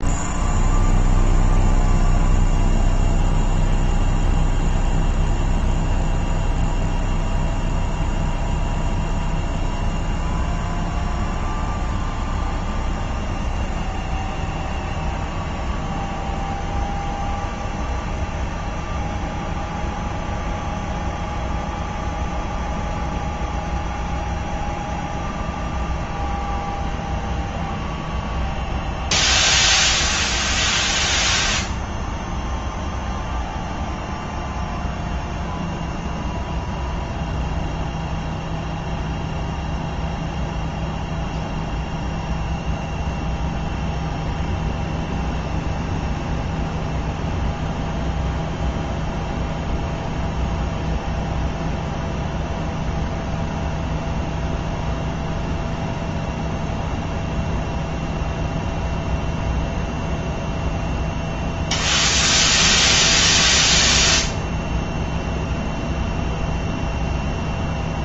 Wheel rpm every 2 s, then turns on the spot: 0, 0, 0, 0, 0, 0, 0, 0, 0, 0, 0, 0, 0, 0, 0, 0, 0, 0, 0, 0, 0, 0, 0, 0, 0, 0, 0, 0, 0, 0, 0, 0, 0, 0.
none